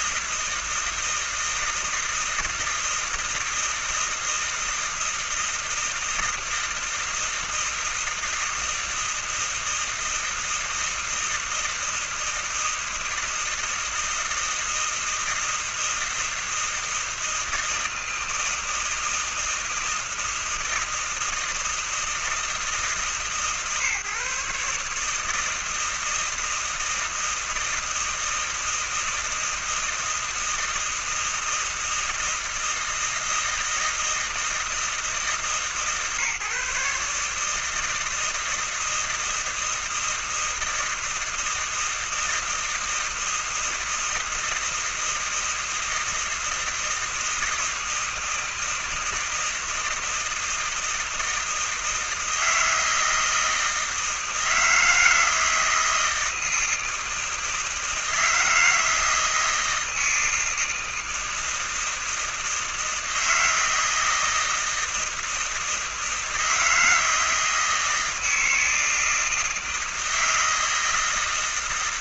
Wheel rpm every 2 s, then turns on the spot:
160, 160, 160, 160, 160, 160, 160, 160, 160, 160, 160, 160, 140, 160, 160, 160, 160, 160, 140, 160, 160, 160, 160, 160, 160, 160, 160, 160, 160, 160, 160, 160, 160, 160, 160, 160.
none